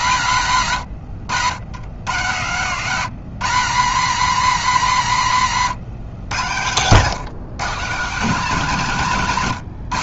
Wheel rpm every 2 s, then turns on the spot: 90, 160, 130, 150, 160.
none